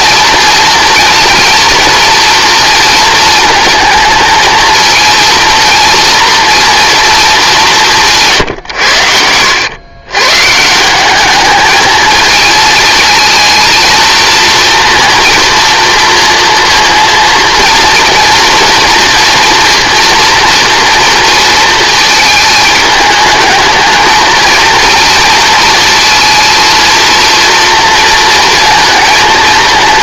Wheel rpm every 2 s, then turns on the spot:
230, 230, 230, 230, 140, 150, 220, 230, 230, 230, 230, 220, 230, 230, 230.
none